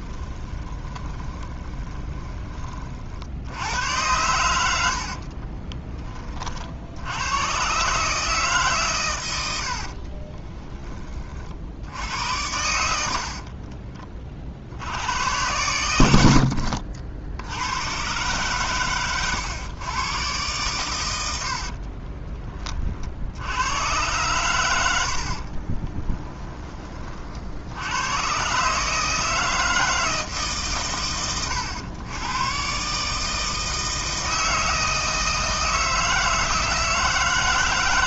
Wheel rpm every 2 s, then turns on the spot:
20, 80, 40, 100, 100, 20, 10, 90, 60, 110, 110, 40, 70, 20, 150, 130, 130, 160, 160.
0-2 4-6 12-14 24-26